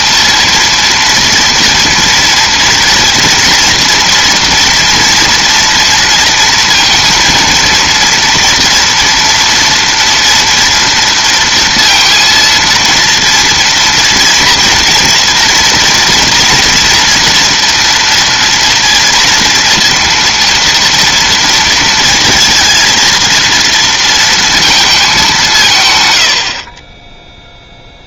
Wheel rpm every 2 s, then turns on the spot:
230, 240, 230, 230, 230, 230, 230, 230, 230, 230, 230, 230, 200, 10.
none